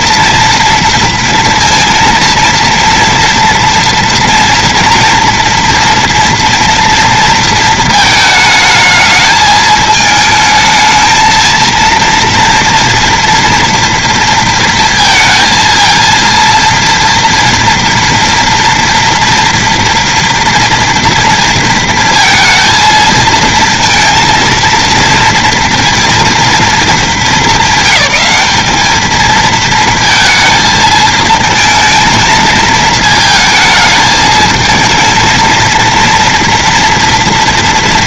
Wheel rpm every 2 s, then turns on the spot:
230, 230, 230, 230, 220, 220, 230, 230, 230, 240, 230, 220, 230, 220, 210, 220, 220, 220, 230.
none